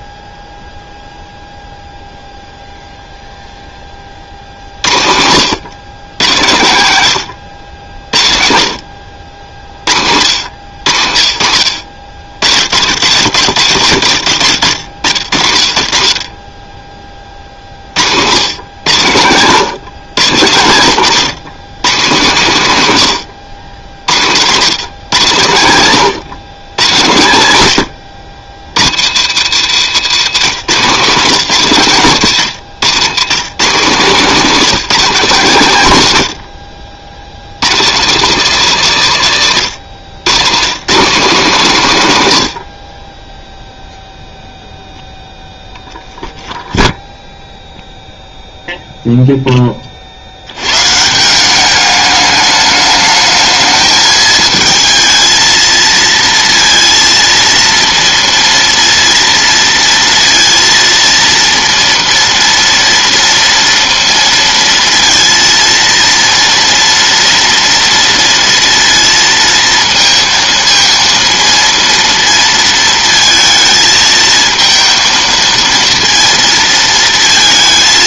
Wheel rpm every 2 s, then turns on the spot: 0, 0, 60, 100, 60, 80, 100, 60, 30, 110, 130, 120, 120, 130, 90, 150, 130, 210, 80, 180, 160, 60, 0, 0, 0, 120, 210, 220, 230, 230, 230, 230, 230, 230, 230, 230, 230, 220, 230.
none